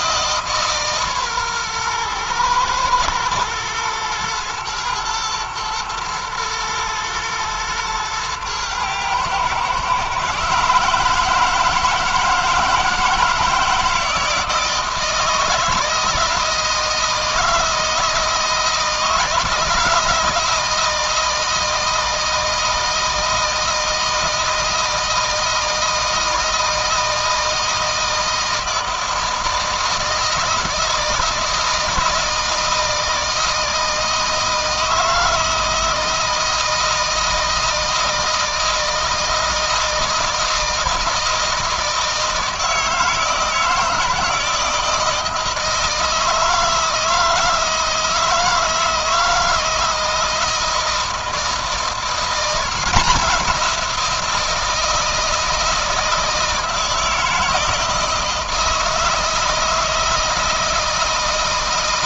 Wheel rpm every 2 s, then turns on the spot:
140, 110, 110, 110, 110, 150, 160, 160, 160, 160, 160, 160, 160, 160, 160, 160, 160, 160, 170, 160, 160, 160, 160, 160, 160, 160, 180, 160, 160, 160, 160.
none